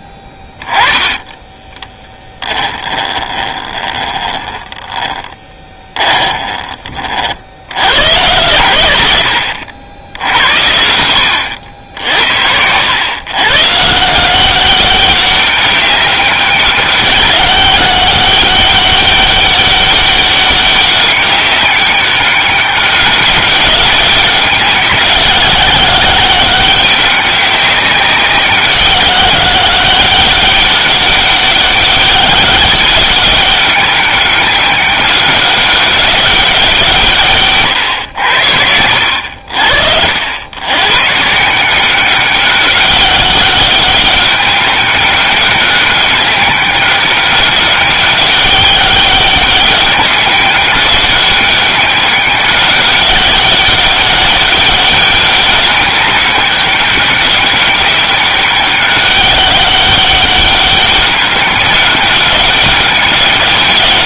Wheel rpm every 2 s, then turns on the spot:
10, 20, 30, 30, 100, 90, 90, 190, 190, 200, 200, 200, 190, 190, 190, 200, 200, 200, 170, 90, 110, 190, 200, 200, 200, 200, 200, 200, 200, 200, 200, 200.
2-6